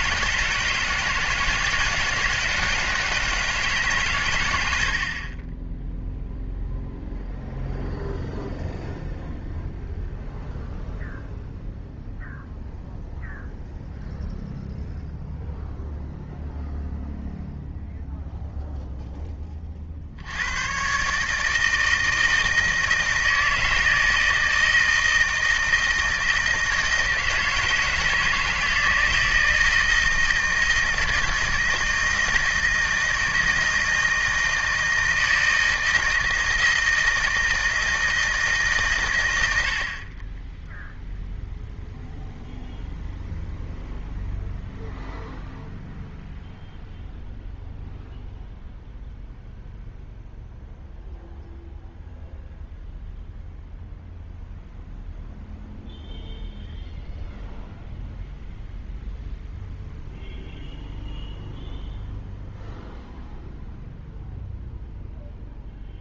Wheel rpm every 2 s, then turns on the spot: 160, 160, 100, 0, 0, 0, 0, 0, 0, 0, 120, 160, 160, 160, 160, 160, 160, 160, 160, 140, 10, 0, 0, 0, 0, 0, 0, 0, 0, 0, 0, 0, 0.
none